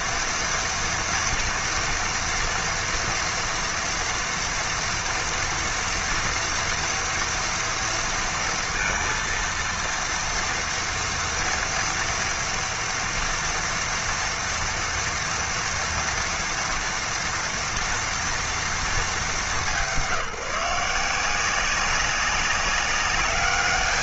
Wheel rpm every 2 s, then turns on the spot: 230, 230, 230, 230, 230, 230, 230, 230, 230, 230, 170, 190.
none